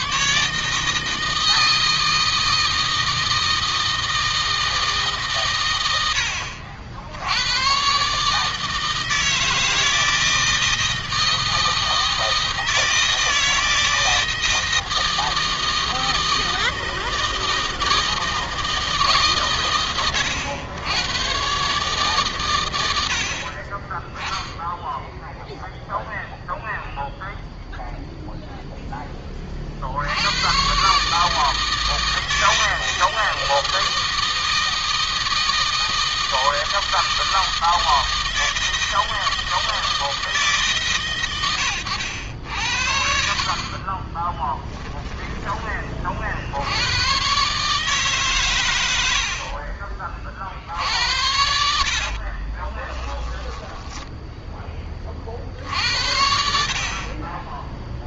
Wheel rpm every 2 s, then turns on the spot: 160, 160, 150, 70, 160, 160, 160, 160, 160, 160, 110, 80, 0, 0, 10, 130, 160, 160, 160, 160, 140, 70, 10, 90, 90, 80, 20, 30, 50.
44-46 50-54